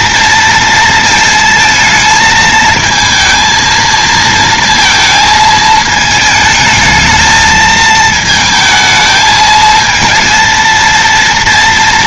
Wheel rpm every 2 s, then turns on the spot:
230, 220, 230, 220, 220, 230.
none